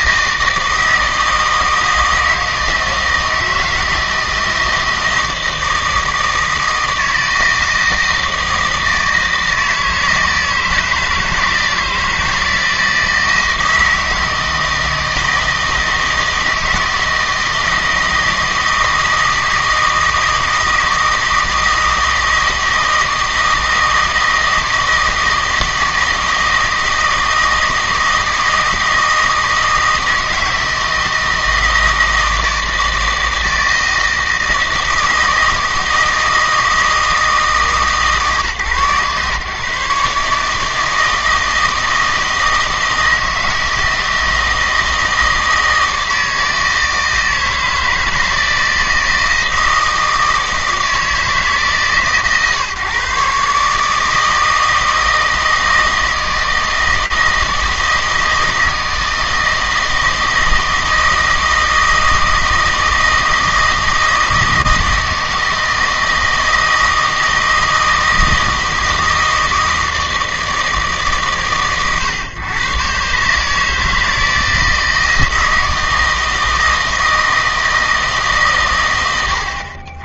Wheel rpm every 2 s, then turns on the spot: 160, 160, 160, 160, 160, 160, 160, 160, 160, 160, 160, 160, 160, 160, 160, 160, 160, 160, 160, 140, 160, 160, 160, 160, 160, 160, 140, 160, 160, 160, 160, 160, 160, 160, 160, 150, 130, 160, 160, 80.
none